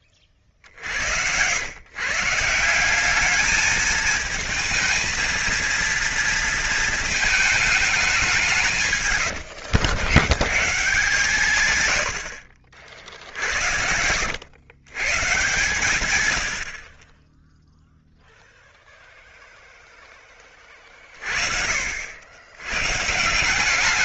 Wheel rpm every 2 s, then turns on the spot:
60, 180, 230, 220, 150, 120, 60, 120, 50, 0, 30, 100.
none